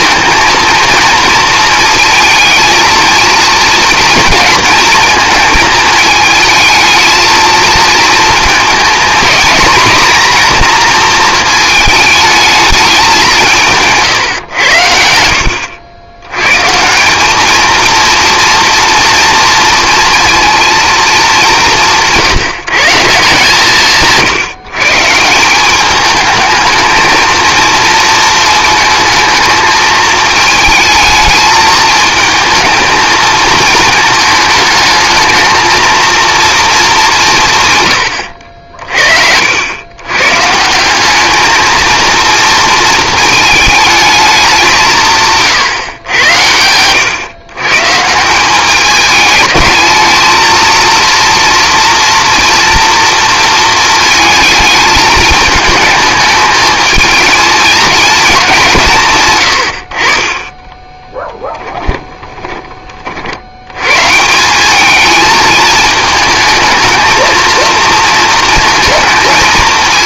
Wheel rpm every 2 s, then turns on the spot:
230, 220, 220, 220, 230, 240, 210, 90, 150, 230, 230, 170, 140, 220, 220, 220, 220, 220, 220, 60, 170, 230, 180, 100, 200, 230, 230, 220, 220, 160, 20, 30, 200, 220, 220.
60-62